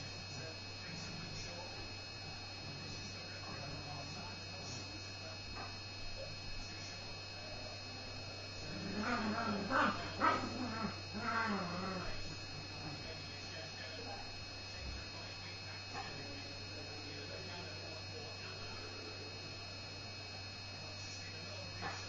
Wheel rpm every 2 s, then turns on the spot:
0, 0, 0, 0, 0, 0, 0, 0, 0, 0, 0.
none